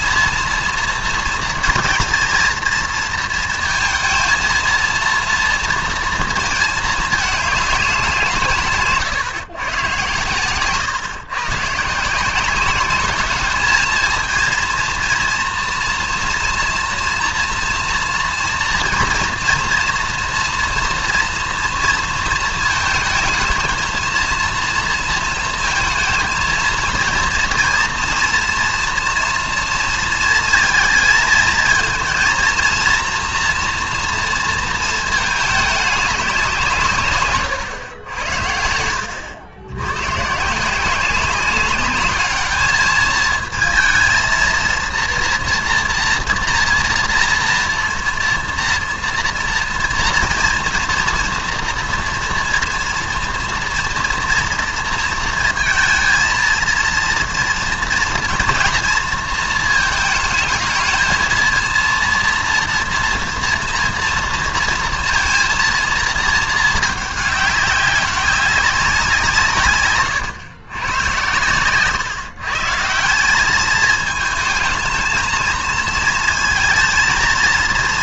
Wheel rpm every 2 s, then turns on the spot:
230, 220, 230, 220, 140, 130, 210, 230, 230, 230, 230, 220, 230, 220, 230, 230, 230, 230, 170, 80, 170, 220, 230, 230, 230, 230, 230, 230, 230, 230, 220, 230, 230, 220, 190, 120, 150, 220, 220.
none